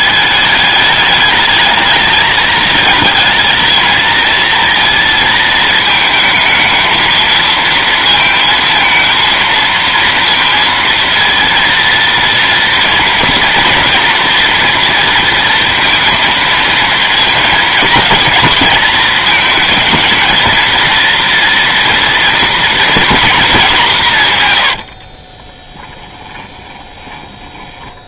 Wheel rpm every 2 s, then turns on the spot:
220, 230, 220, 230, 230, 230, 230, 230, 220, 220, 230, 150, 20, 70.
24-26